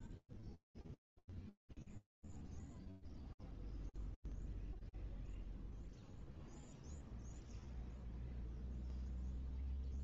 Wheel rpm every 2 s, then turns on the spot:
0, 0, 0, 0, 0.
none